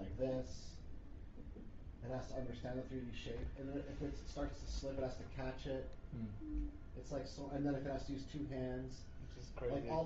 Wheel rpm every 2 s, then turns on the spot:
0, 0, 0, 0, 0.
none